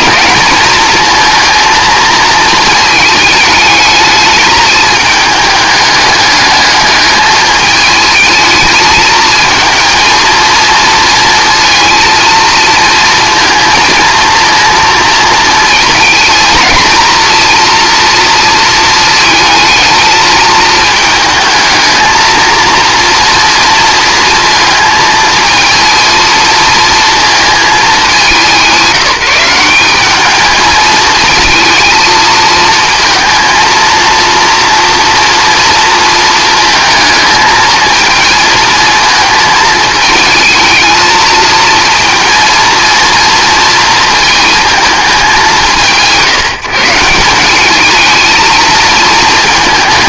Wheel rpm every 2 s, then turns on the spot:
220, 220, 210, 210, 220, 220, 230, 230, 220, 230, 220, 230, 230, 230, 190, 220, 220, 230, 230, 220, 220, 230, 220, 160, 220.
none